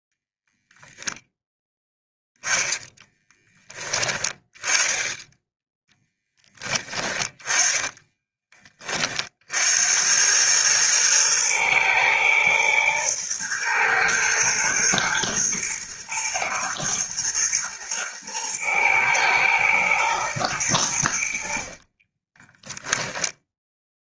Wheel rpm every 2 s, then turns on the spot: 0, 10, 10, 20, 30, 110, 110, 110, 120, 120, 90, 10.
6-8 22-24